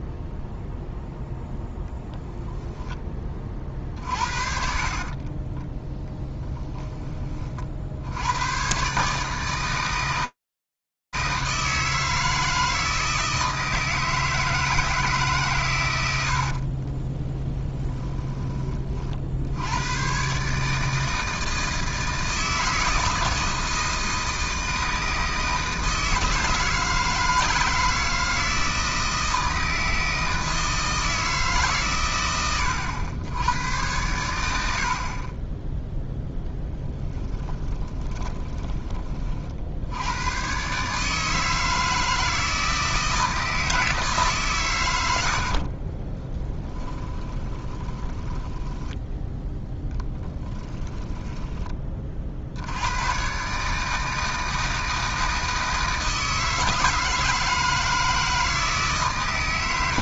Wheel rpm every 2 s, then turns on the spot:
0, 10, 50, 10, 130, 160, 160, 130, 10, 60, 160, 160, 160, 160, 160, 160, 90, 30, 30, 30, 160, 160, 70, 20, 10, 10, 110, 160, 160, 140.
2-6 16-18 36-38 46-48 50-52